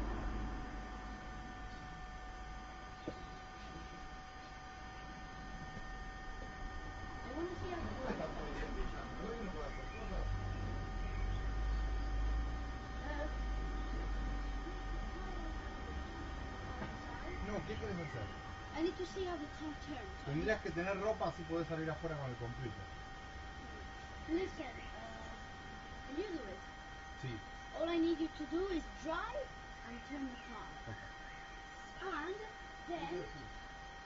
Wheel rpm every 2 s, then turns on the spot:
0, 0, 0, 0, 0, 0, 0, 0, 0, 0, 0, 0, 0, 0, 0, 0, 0.
none